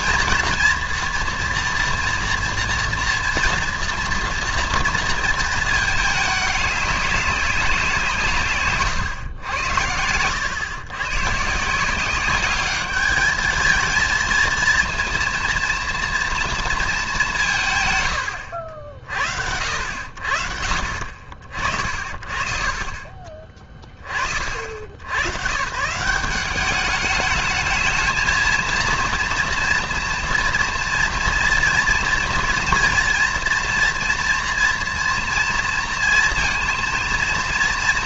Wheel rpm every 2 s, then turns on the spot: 230, 230, 230, 210, 140, 110, 200, 230, 230, 70, 50, 40, 60, 200, 230, 230, 230, 230, 230.
22-24